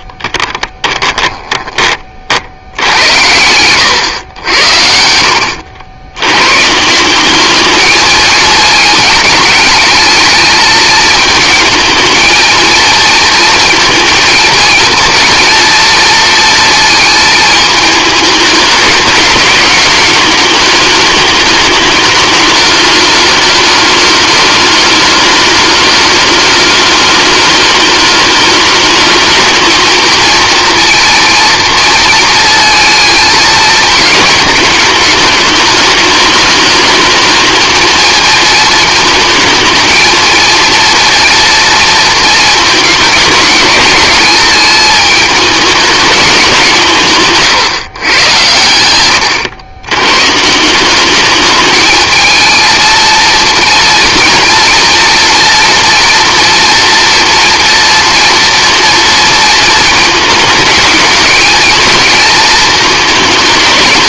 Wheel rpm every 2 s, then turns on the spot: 10, 80, 80, 170, 220, 220, 230, 230, 230, 210, 210, 210, 210, 210, 220, 230, 220, 210, 220, 220, 230, 210, 210, 170, 100, 190, 230, 240, 240, 230, 220, 220.
0-2